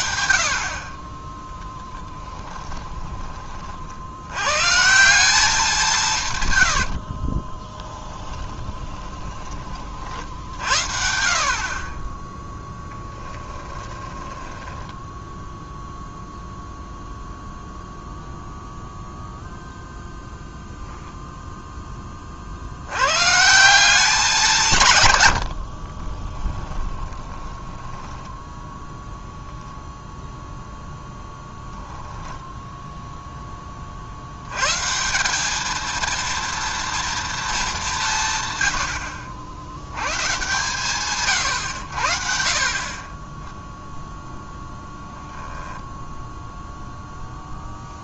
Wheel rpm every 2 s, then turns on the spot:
40, 10, 150, 80, 20, 70, 10, 10, 0, 0, 0, 90, 140, 20, 0, 0, 0, 140, 230, 90, 130, 40, 0, 0.
2-4 6-10 12-16 26-28